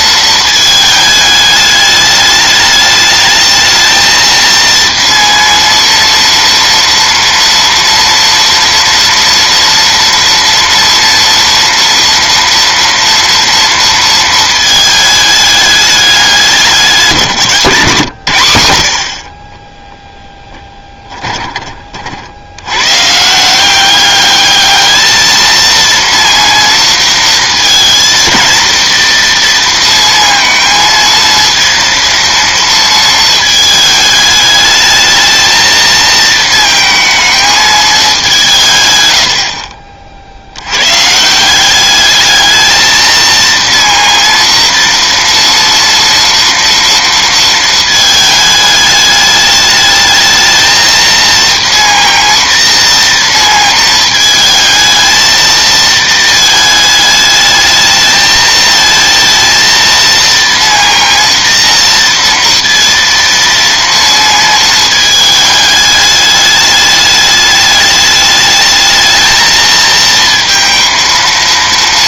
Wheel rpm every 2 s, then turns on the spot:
220, 210, 230, 230, 230, 230, 230, 220, 190, 80, 10, 100, 210, 230, 230, 230, 230, 210, 220, 170, 90, 220, 230, 230, 210, 220, 230, 220, 220, 220, 230, 230, 220, 210, 220, 230.
none